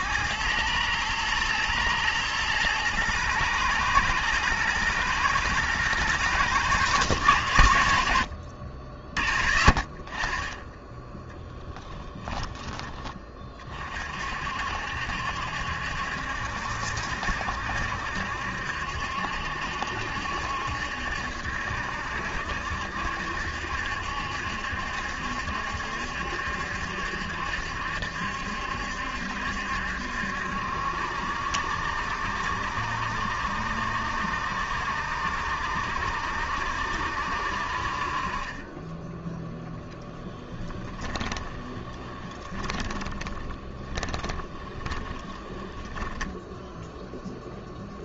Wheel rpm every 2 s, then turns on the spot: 110, 110, 110, 110, 50, 10, 20, 60, 70, 70, 70, 70, 70, 70, 70, 70, 70, 60, 70, 20, 20, 20, 20, 0.
40-46